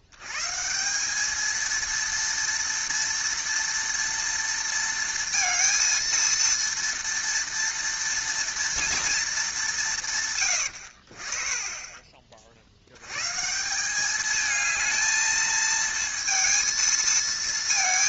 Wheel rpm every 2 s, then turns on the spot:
130, 230, 230, 230, 230, 120, 40, 220, 230.
none